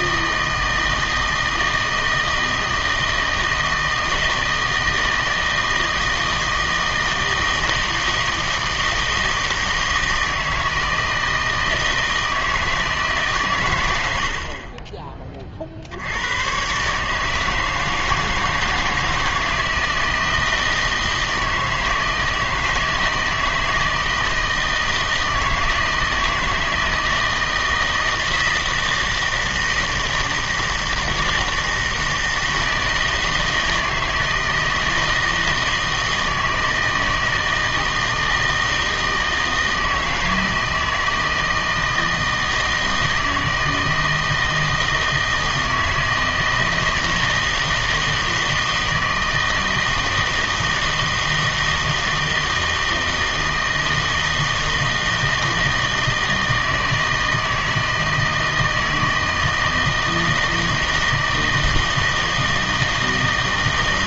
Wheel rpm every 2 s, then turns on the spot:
160, 160, 160, 160, 160, 160, 160, 40, 120, 160, 160, 160, 160, 160, 160, 160, 160, 160, 160, 160, 160, 160, 160, 160, 160, 160, 160, 160, 160, 160, 160, 160.
none